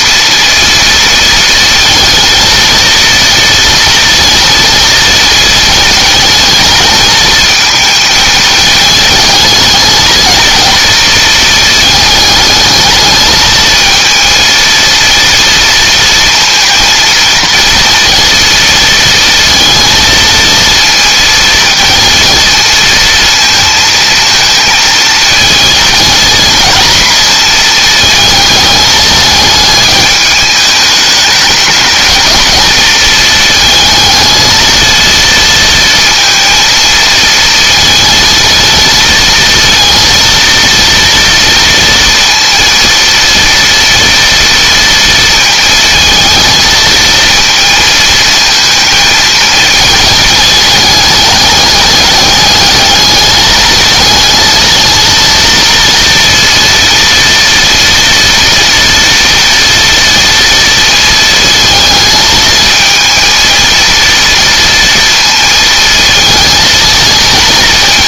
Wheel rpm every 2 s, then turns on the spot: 230, 220, 230, 220, 220, 220, 220, 230, 230, 230, 230, 220, 220, 230, 210, 210, 220, 230, 230, 230, 230, 230, 230, 220, 220, 210, 210, 230, 230, 230, 230, 230, 230, 230.
none